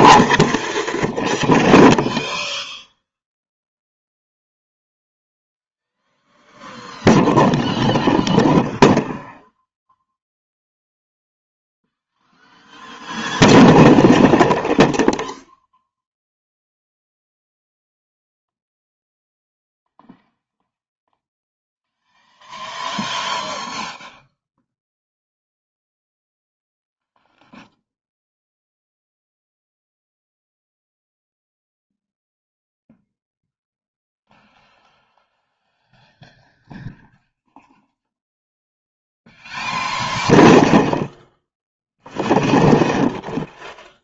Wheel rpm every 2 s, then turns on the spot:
0, 0, 0, 0, 0, 0, 0, 0, 0, 0, 0, 0, 0, 0, 0, 0, 0, 0, 0, 0, 0, 0.
none